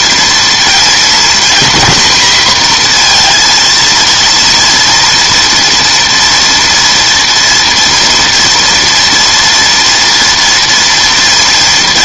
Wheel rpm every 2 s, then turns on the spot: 230, 240, 230, 230, 230, 230.
none